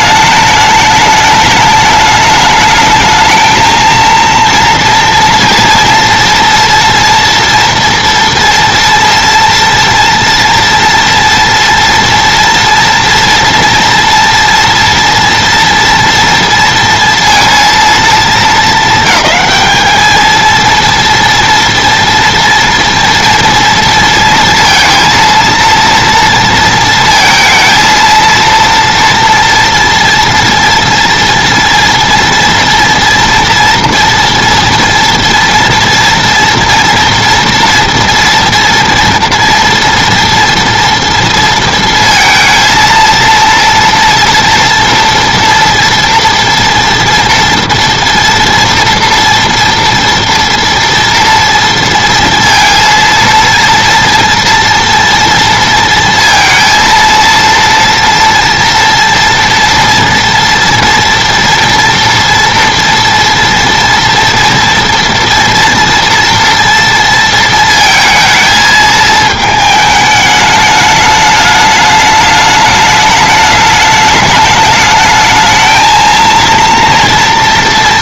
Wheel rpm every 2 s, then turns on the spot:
210, 210, 230, 230, 230, 230, 240, 230, 230, 210, 230, 230, 230, 230, 230, 230, 230, 230, 230, 230, 230, 230, 230, 230, 230, 230, 230, 230, 230, 230, 230, 230, 240, 230, 220, 210, 220, 220, 230.
none